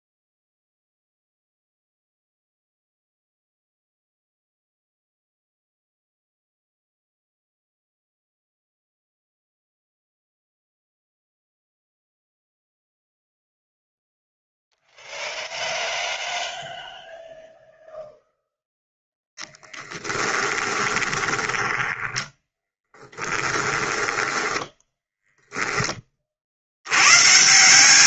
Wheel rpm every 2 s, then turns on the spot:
0, 0, 0, 0, 0, 0, 0, 0, 0, 0, 20, 10, 10, 70.
20-24